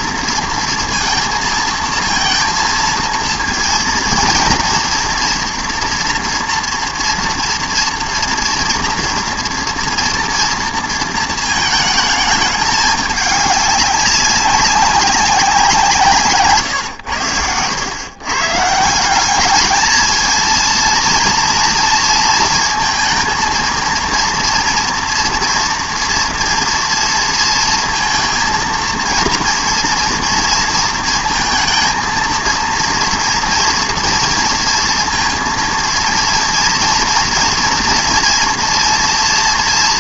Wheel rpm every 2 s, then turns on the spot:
230, 230, 230, 230, 230, 230, 210, 190, 130, 140, 230, 230, 230, 230, 230, 230, 230, 230, 230, 230.
none